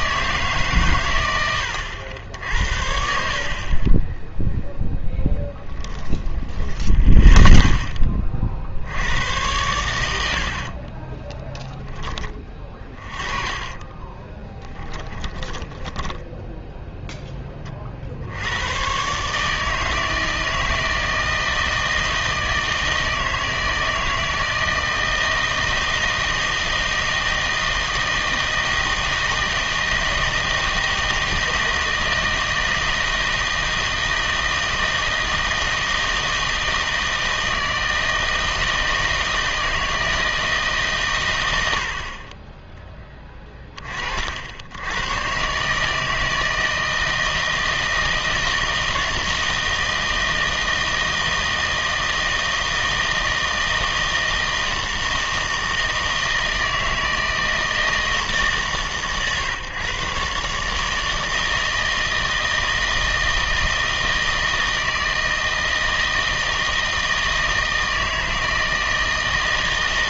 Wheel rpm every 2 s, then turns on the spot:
140, 70, 0, 10, 60, 50, 20, 10, 0, 110, 160, 160, 160, 160, 160, 160, 160, 160, 160, 160, 140, 20, 80, 160, 160, 160, 160, 160, 160, 150, 150, 160, 160, 160, 160.
2-4 6-8 10-16